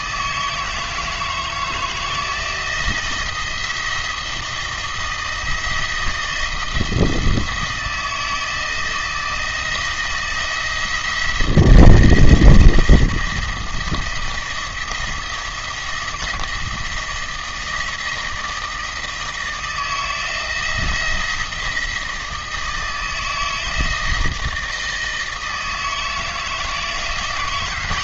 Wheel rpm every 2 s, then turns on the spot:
160, 160, 160, 160, 160, 170, 170, 170, 170, 160, 170, 160, 160, 170.
none